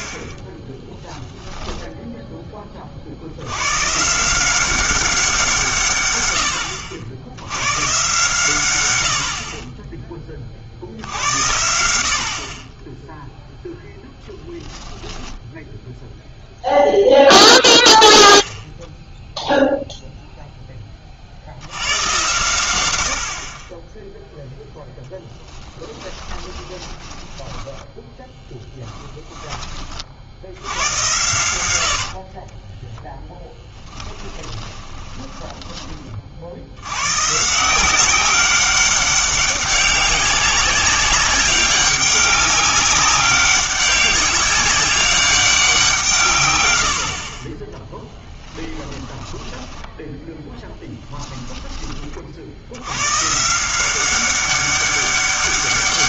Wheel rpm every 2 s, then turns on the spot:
10, 30, 190, 80, 120, 60, 20, 10, 0, 10, 10, 100, 0, 20, 10, 90, 20, 10, 80, 200, 190, 200, 200, 90, 10, 0, 60, 190.
0-2 26-30 32-36 48-50